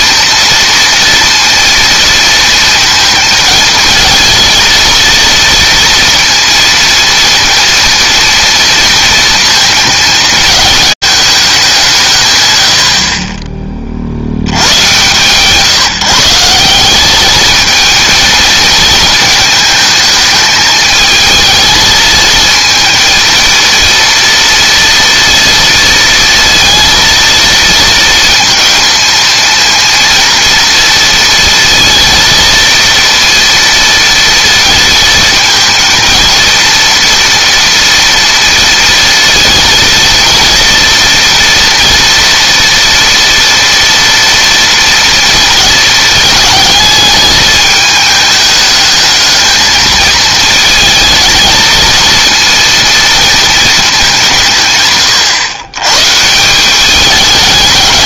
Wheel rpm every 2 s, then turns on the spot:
230, 230, 230, 230, 230, 210, 80, 100, 180, 220, 220, 230, 230, 230, 230, 230, 230, 230, 230, 230, 230, 230, 230, 220, 210, 220, 230, 140, 190.
none